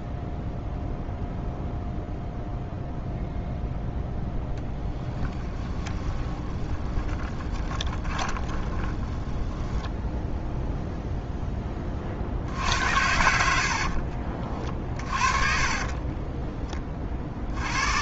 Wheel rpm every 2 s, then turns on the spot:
0, 0, 0, 20, 20, 0, 70, 30, 20.
6-10 14-16